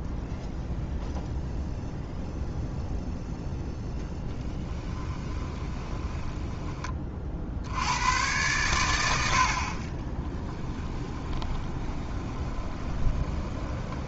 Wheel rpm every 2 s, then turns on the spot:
0, 0, 10, 20, 100, 20, 20.
4-6 10-14